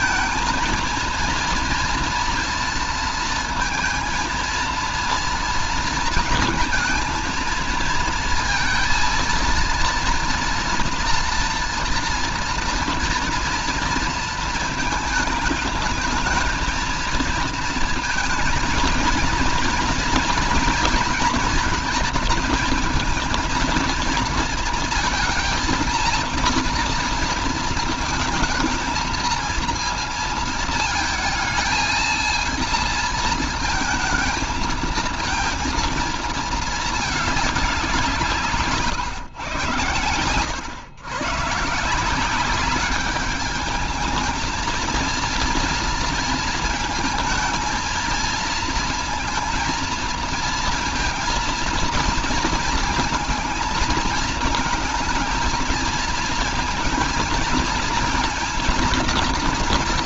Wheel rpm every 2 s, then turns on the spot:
230, 230, 230, 220, 230, 230, 230, 220, 220, 220, 230, 230, 230, 230, 220, 220, 220, 220, 220, 150, 120, 190, 230, 230, 230, 230, 230, 220, 220, 230.
none